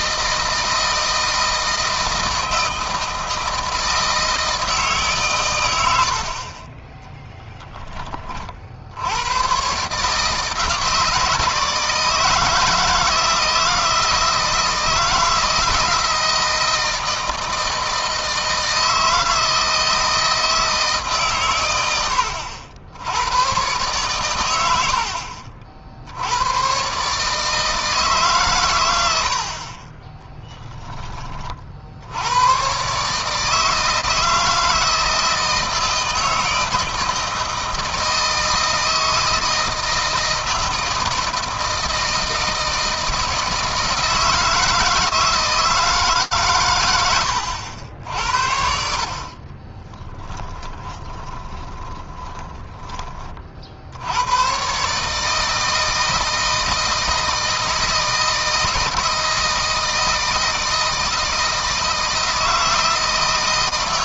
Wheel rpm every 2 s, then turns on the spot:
160, 160, 150, 30, 70, 150, 160, 160, 160, 160, 150, 80, 80, 120, 110, 10, 130, 160, 160, 160, 160, 160, 160, 110, 60, 20, 30, 140, 160, 160, 160, 160.
6-8 48-52